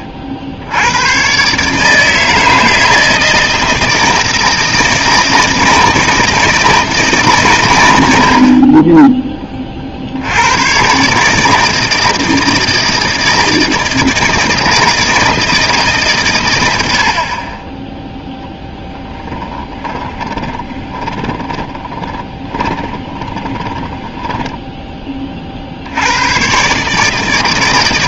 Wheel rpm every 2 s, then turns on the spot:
80, 160, 160, 160, 30, 120, 160, 160, 80, 10, 20, 20, 10, 140.
18-24